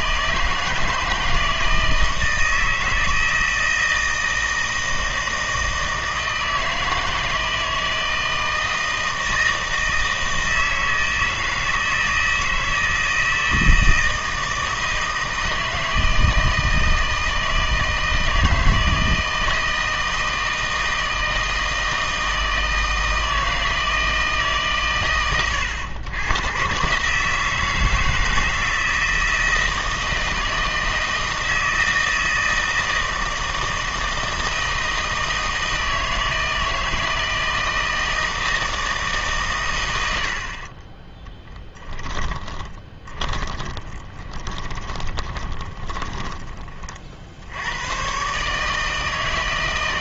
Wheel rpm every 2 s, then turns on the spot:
160, 160, 160, 160, 160, 160, 160, 160, 160, 160, 160, 160, 140, 120, 160, 160, 160, 160, 160, 160, 50, 20, 20, 30, 150.
40-46